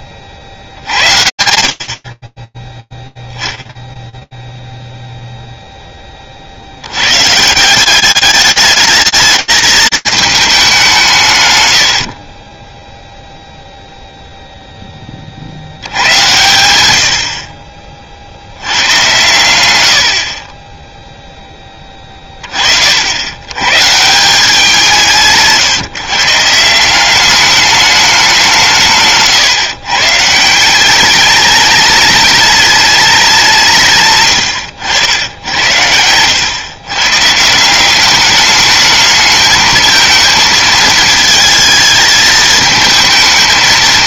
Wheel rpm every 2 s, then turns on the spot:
100, 0, 0, 80, 210, 190, 10, 20, 80, 100, 10, 110, 150, 210, 140, 210, 160, 80, 160, 220, 220, 220.
none